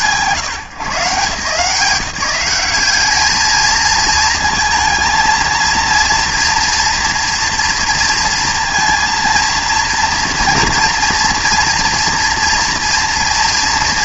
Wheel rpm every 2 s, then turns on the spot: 150, 190, 230, 230, 230, 230, 230.
none